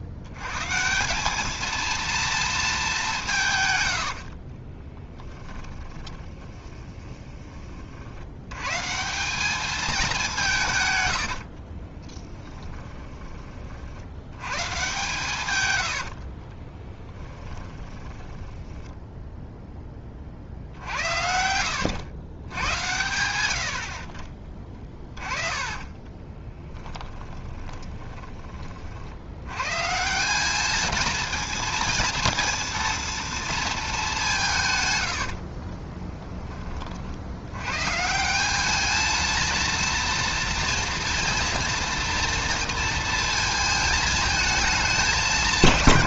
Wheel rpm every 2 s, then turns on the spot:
160, 210, 20, 20, 140, 130, 20, 130, 20, 10, 60, 100, 20, 10, 40, 220, 230, 140, 30, 210, 230, 230, 220.
4-8 12-14 16-22 24-28